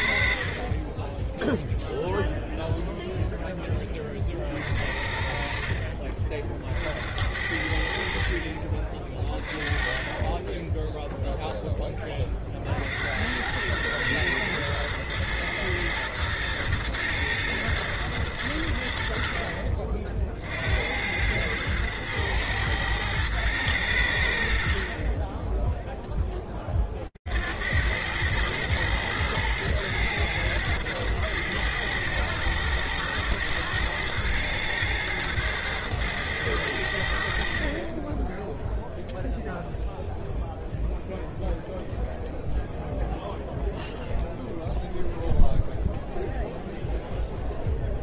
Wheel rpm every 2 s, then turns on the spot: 50, 0, 40, 50, 50, 20, 50, 110, 110, 100, 60, 110, 70, 20, 110, 110, 110, 110, 100, 10, 0, 0, 0, 0.
none